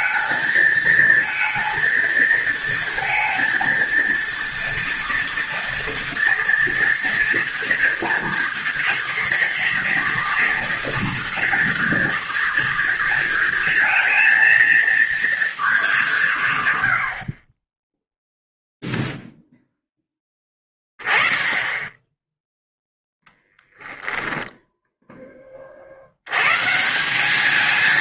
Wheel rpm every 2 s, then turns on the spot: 220, 230, 230, 240, 230, 230, 230, 230, 160, 0, 10, 10, 10, 110.
24-26